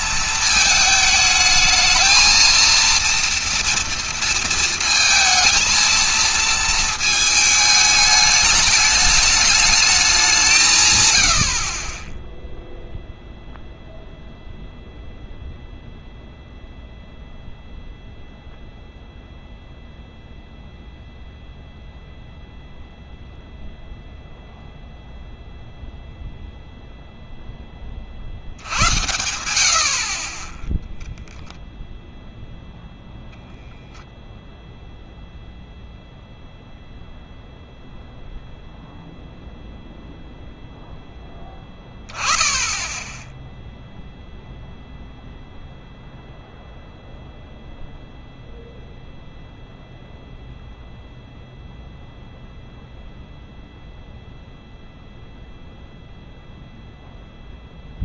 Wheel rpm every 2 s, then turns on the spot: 220, 230, 220, 220, 210, 150, 0, 0, 0, 0, 0, 0, 0, 0, 70, 10, 0, 0, 0, 0, 0, 20, 0, 0, 0, 0, 0, 0, 0.
none